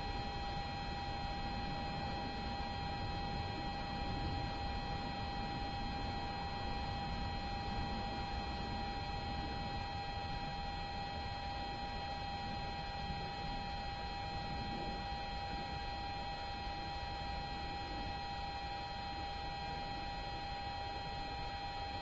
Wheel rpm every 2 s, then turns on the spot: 0, 0, 0, 0, 0, 0, 0, 0, 0, 0, 0.
none